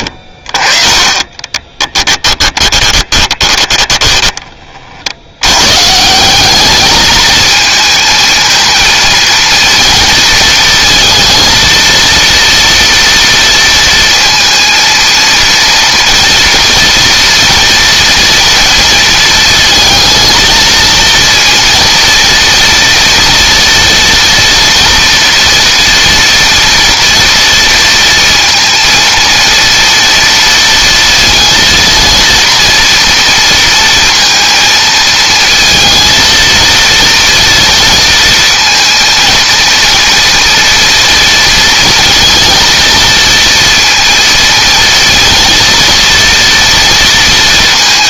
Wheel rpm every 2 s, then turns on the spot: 40, 30, 40, 210, 230, 230, 240, 230, 230, 230, 220, 230, 230, 230, 230, 230, 230, 220, 230, 230, 230, 230, 230, 230.
2-4